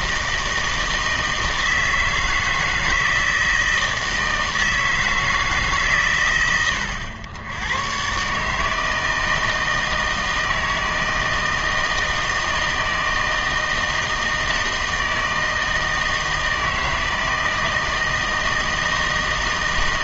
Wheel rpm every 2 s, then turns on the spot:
160, 160, 160, 110, 150, 160, 160, 160, 160, 160.
none